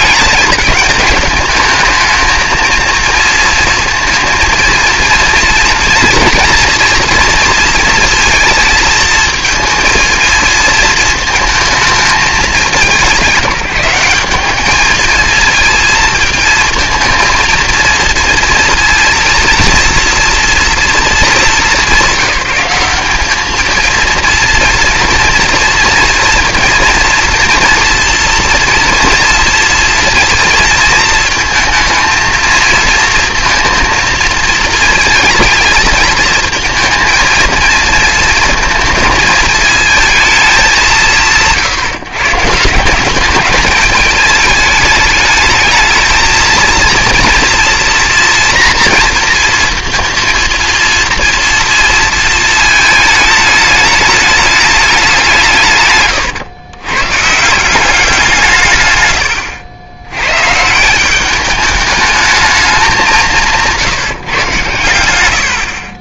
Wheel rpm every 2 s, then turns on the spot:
210, 230, 230, 240, 230, 220, 200, 210, 220, 230, 230, 190, 230, 230, 230, 230, 220, 220, 230, 230, 180, 170, 210, 230, 240, 230, 220, 210, 120, 130, 120, 200, 120.
none